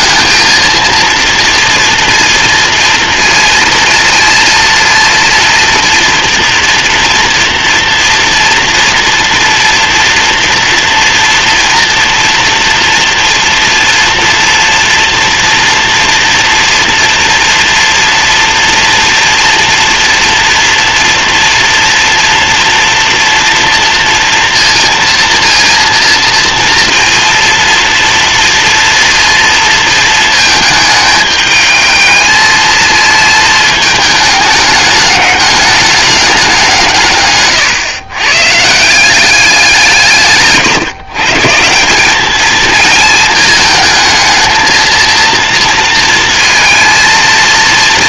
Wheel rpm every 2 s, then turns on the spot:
230, 230, 230, 230, 240, 240, 230, 230, 230, 240, 240, 230, 230, 230, 230, 220, 220, 210, 150, 170, 140, 230, 230, 230.
none